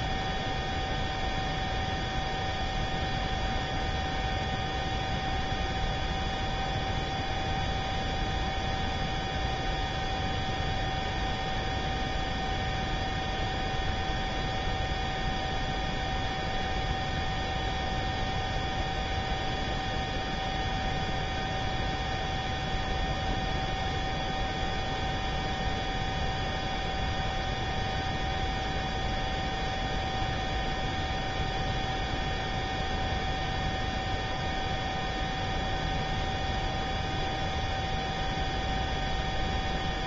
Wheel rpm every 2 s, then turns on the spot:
0, 0, 0, 0, 0, 0, 0, 0, 0, 0, 0, 0, 0, 0, 0, 0, 0, 0, 0, 0.
none